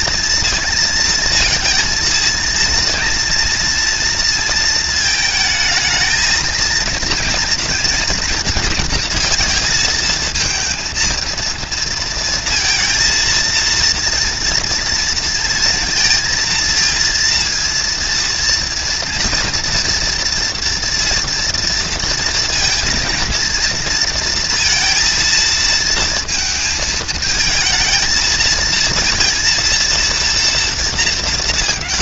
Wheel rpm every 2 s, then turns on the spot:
230, 240, 220, 230, 230, 230, 220, 230, 230, 230, 240, 230, 230, 220, 230, 220.
none